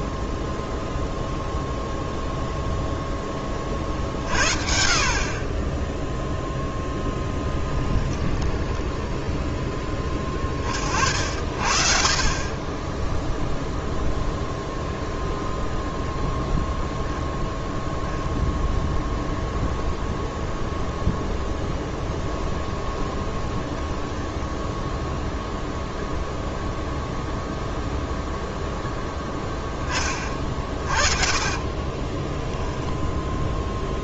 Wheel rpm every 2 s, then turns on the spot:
0, 0, 50, 10, 10, 50, 10, 0, 0, 0, 10, 10, 0, 0, 0, 40, 0.
8-10 12-14 20-22 30-32